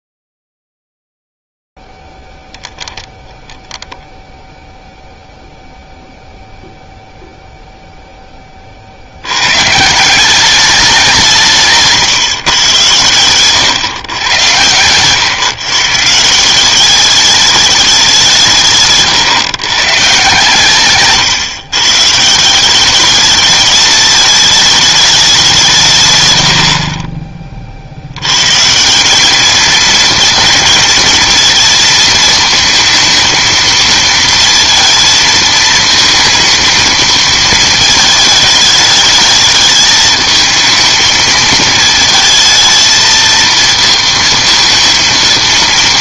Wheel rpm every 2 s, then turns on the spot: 0, 0, 10, 0, 10, 190, 130, 110, 160, 170, 140, 170, 210, 110, 130, 230, 230, 230, 220, 210, 220, 220, 230.
none